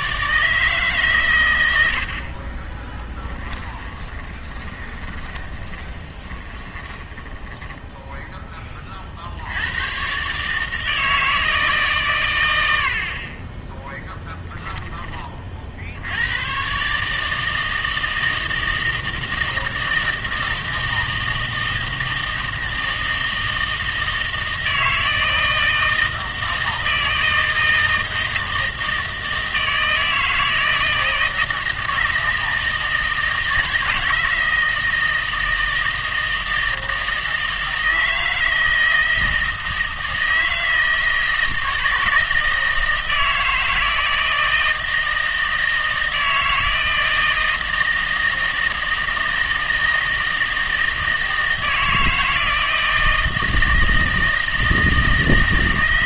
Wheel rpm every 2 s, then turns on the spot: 150, 30, 20, 20, 30, 160, 80, 10, 130, 160, 160, 160, 160, 160, 160, 160, 160, 160, 160, 160, 160, 160, 160, 160, 160, 160, 160, 160.
4-8